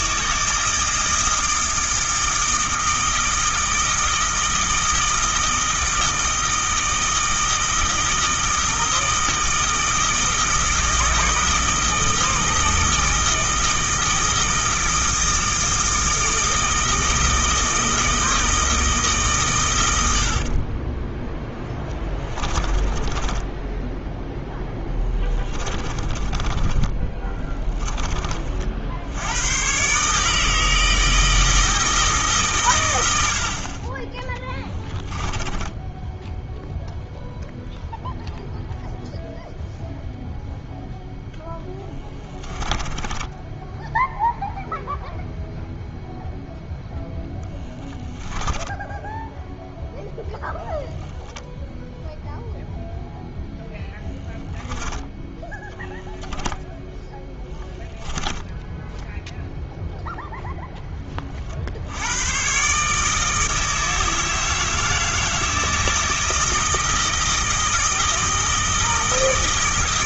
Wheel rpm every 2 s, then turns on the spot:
160, 160, 160, 160, 160, 160, 160, 160, 160, 160, 20, 20, 10, 20, 60, 160, 120, 10, 0, 0, 0, 20, 0, 10, 10, 0, 0, 0, 10, 10, 10, 140, 160, 160, 160.
20-28 34-36 42-44 48-50 56-60